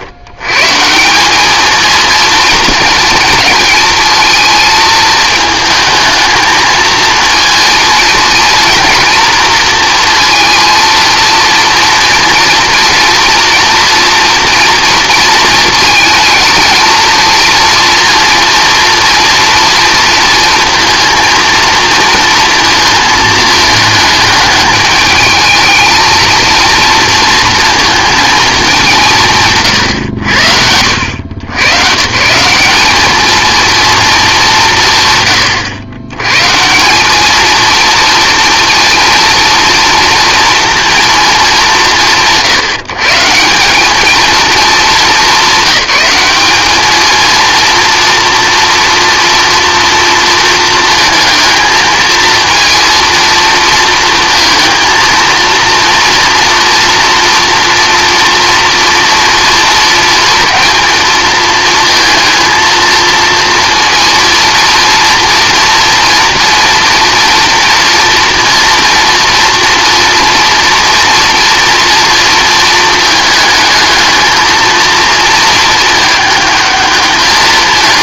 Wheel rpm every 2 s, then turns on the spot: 150, 220, 220, 230, 230, 230, 230, 230, 230, 230, 230, 230, 210, 230, 190, 80, 210, 150, 180, 230, 230, 160, 210, 220, 230, 220, 230, 230, 230, 230, 230, 230, 230, 230, 240, 230, 220, 230, 210.
none